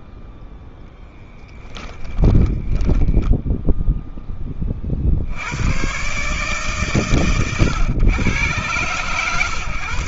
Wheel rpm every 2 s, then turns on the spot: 0, 10, 20, 110, 110.
2-4